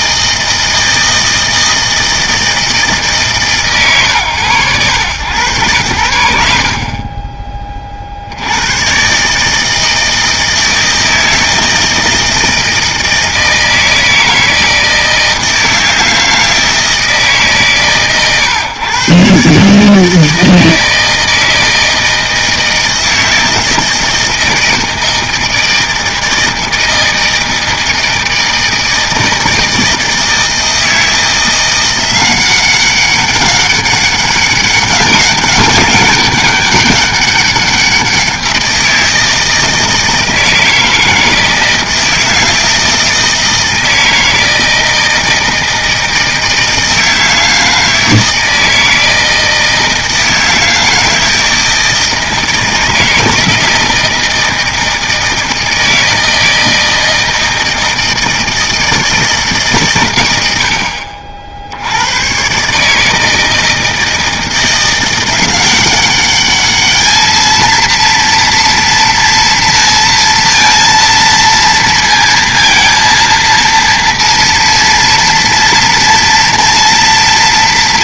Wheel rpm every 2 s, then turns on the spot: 160, 160, 110, 50, 90, 160, 160, 160, 160, 130, 160, 160, 160, 160, 160, 160, 190, 200, 200, 170, 160, 160, 160, 160, 160, 160, 160, 160, 160, 160, 70, 140, 170, 210, 230, 230, 230, 230, 230.
6-8